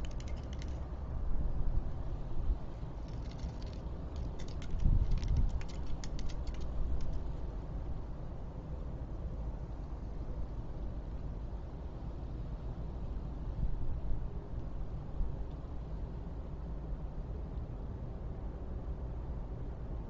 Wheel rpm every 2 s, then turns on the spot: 0, 0, 0, 0, 0, 0, 0, 0, 0, 0.
none